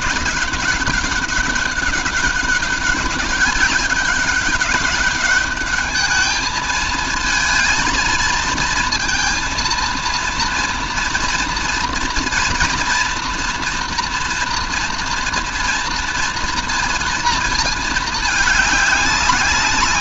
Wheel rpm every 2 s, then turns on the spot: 200, 200, 200, 220, 230, 230, 230, 230, 230, 210.
none